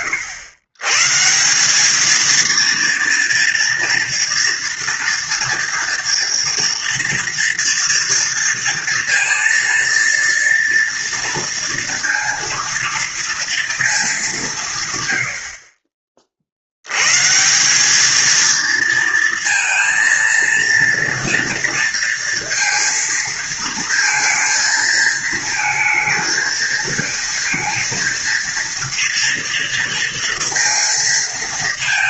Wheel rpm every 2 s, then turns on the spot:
130, 230, 240, 230, 230, 230, 230, 130, 110, 230, 230, 230, 230, 230, 230, 230.
none